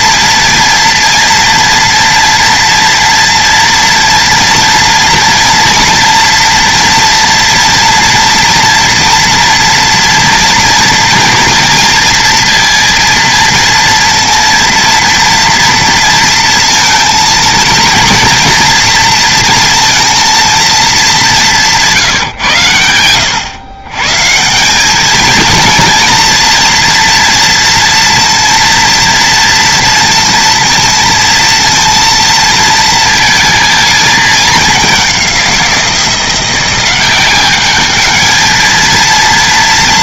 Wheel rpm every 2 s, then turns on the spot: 230, 230, 230, 230, 230, 230, 230, 230, 230, 230, 220, 110, 210, 230, 230, 230, 230, 200, 180, 230.
none